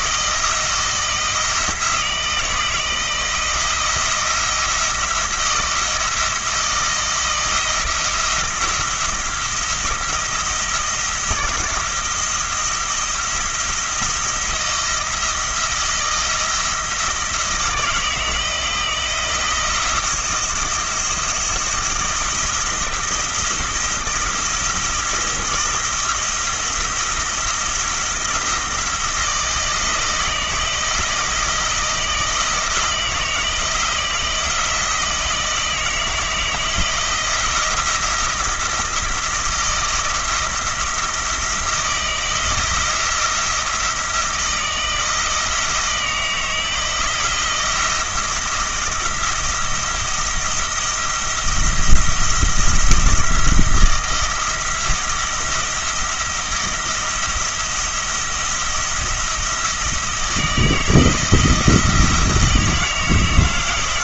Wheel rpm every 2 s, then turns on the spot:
160, 170, 170, 170, 170, 160, 170, 170, 160, 170, 170, 170, 170, 160, 160, 160, 170, 160, 160, 160, 170, 170, 160, 160, 160, 170, 170, 170, 170, 170, 160, 160.
none